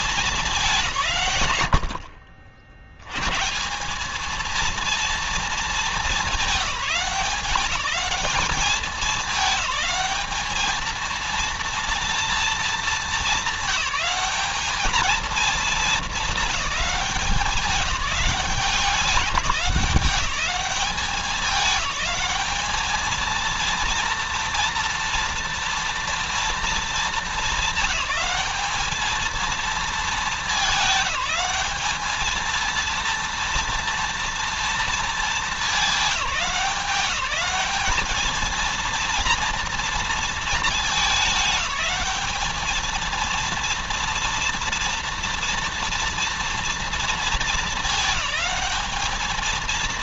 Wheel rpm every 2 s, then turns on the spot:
190, 60, 220, 200, 210, 220, 220, 200, 210, 190, 190, 200, 230, 220, 200, 220, 220, 230, 200, 220, 220, 210, 230, 230, 210.
none